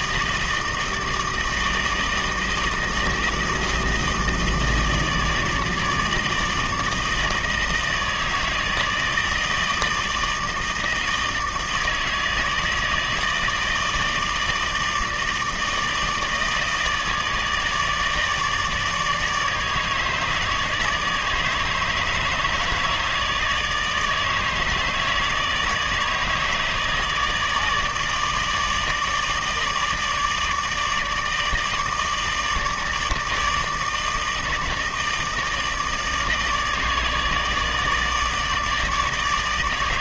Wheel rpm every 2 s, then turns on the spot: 160, 160, 160, 160, 160, 160, 160, 160, 160, 150, 150, 150, 150, 150, 150, 150, 150, 160, 160, 160.
none